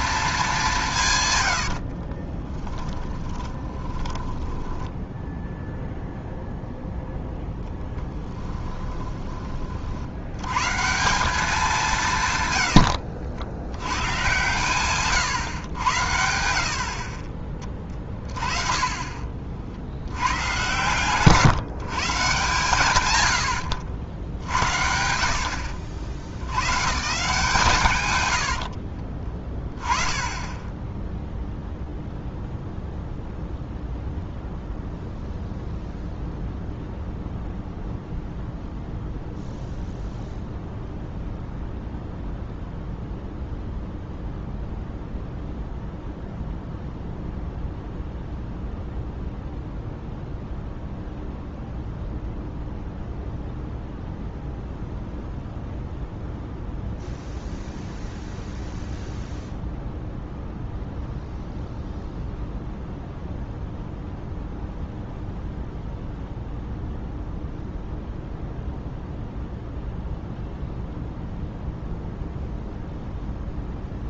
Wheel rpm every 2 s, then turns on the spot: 180, 10, 10, 0, 20, 140, 100, 120, 60, 20, 120, 130, 70, 130, 60, 10, 0, 0, 0, 0, 0, 0, 0, 0, 0, 0, 0, 0, 0, 0, 0, 0, 0, 0, 0, 0, 0.
2-6 8-10 12-14 28-30